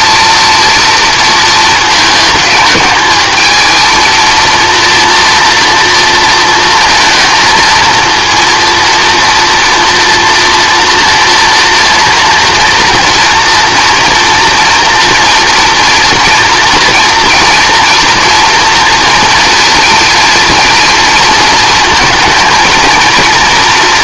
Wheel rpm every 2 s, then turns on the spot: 230, 210, 240, 230, 230, 240, 230, 230, 230, 230, 230, 220.
none